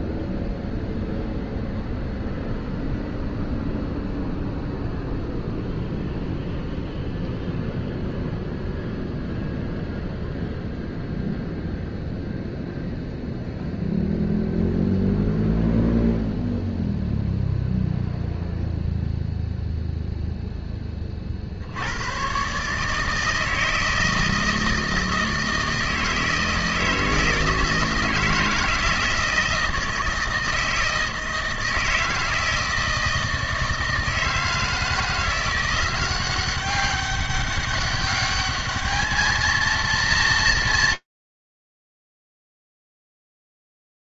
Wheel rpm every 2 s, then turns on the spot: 0, 0, 0, 0, 0, 0, 0, 0, 0, 0, 20, 150, 160, 160, 160, 160, 160, 170, 190, 220, 90, 0.
none